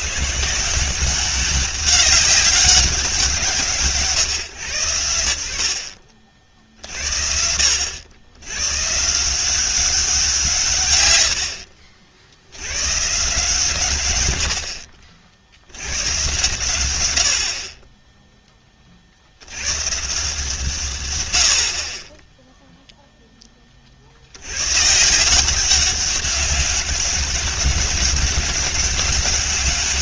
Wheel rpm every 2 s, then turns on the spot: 170, 200, 120, 60, 120, 140, 110, 60, 110, 30, 140, 0, 120, 200, 200.
none